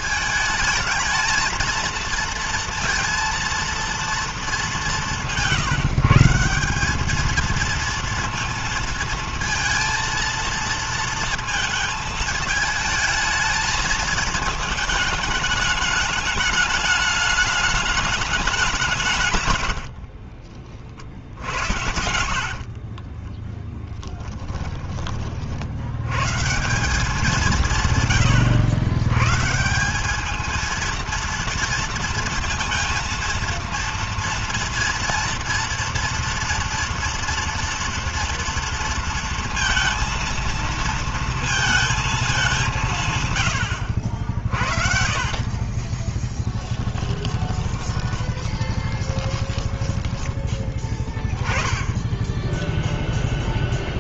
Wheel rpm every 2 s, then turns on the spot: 220, 230, 190, 190, 230, 230, 220, 220, 210, 190, 40, 50, 20, 180, 110, 230, 230, 230, 230, 230, 230, 170, 50, 10, 20, 10, 0.
22-24 44-50